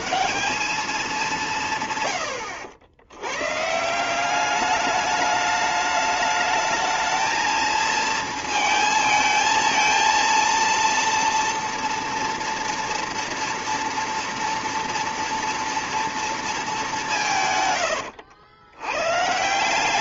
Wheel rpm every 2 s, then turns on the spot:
210, 90, 210, 220, 220, 230, 230, 230, 200, 100.
none